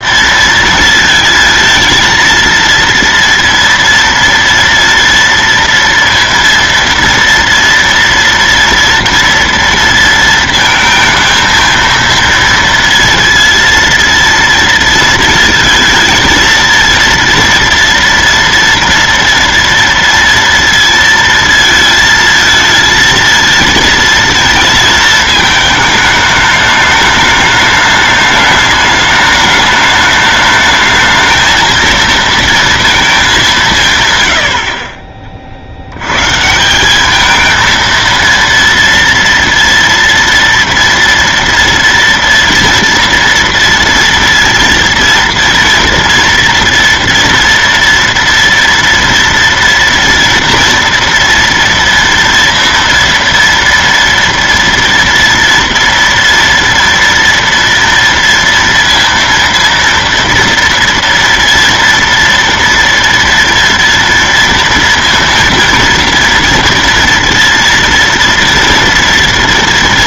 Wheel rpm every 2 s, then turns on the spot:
230, 230, 230, 230, 230, 220, 230, 230, 230, 230, 230, 220, 230, 210, 210, 210, 230, 90, 150, 230, 230, 230, 230, 230, 230, 230, 230, 230, 230, 230, 230, 230, 230, 230, 230.
none